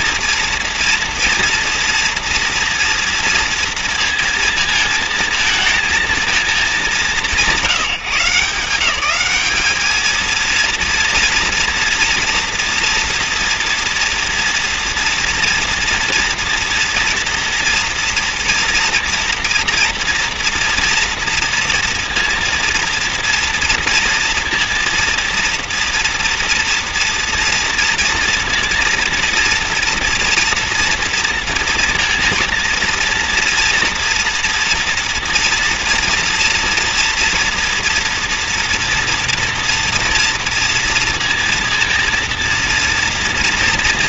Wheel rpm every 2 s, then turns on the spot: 230, 230, 230, 190, 170, 230, 230, 240, 230, 230, 240, 230, 230, 230, 230, 230, 230, 230, 230, 230, 230, 230.
none